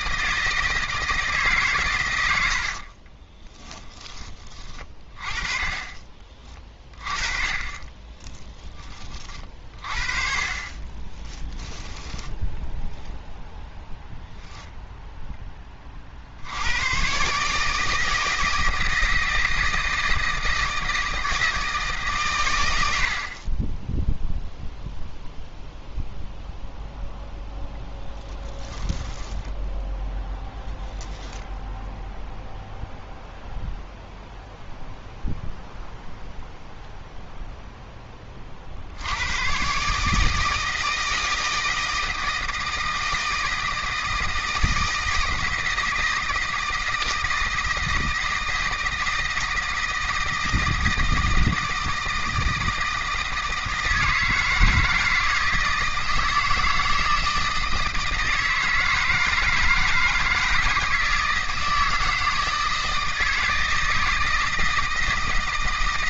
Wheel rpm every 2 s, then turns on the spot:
160, 60, 20, 30, 20, 20, 20, 0, 100, 160, 160, 90, 0, 0, 10, 10, 0, 0, 0, 60, 160, 160, 160, 160, 160, 160, 160, 170, 160, 160, 160, 160, 160.
2-6 10-14 28-30